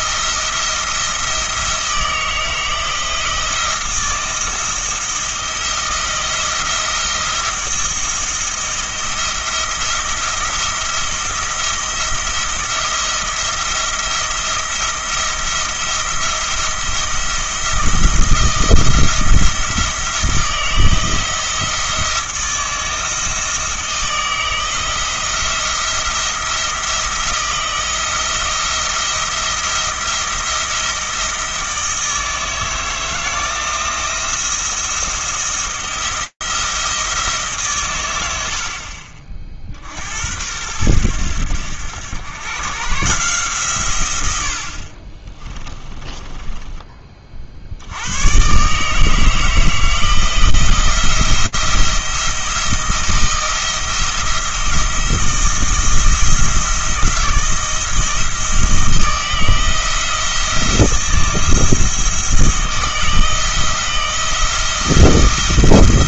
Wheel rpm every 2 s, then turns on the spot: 170, 160, 160, 160, 170, 170, 170, 170, 170, 160, 170, 160, 170, 170, 170, 170, 160, 170, 170, 70, 90, 130, 60, 20, 140, 170, 170, 160, 160, 160, 170, 160, 170.
44-46